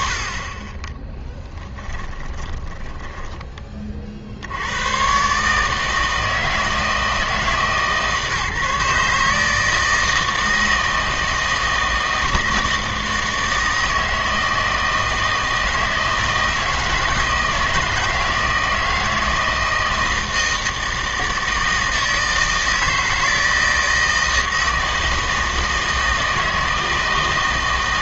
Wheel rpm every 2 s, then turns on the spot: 20, 20, 90, 160, 150, 160, 160, 160, 160, 160, 160, 160, 160, 160.
2-4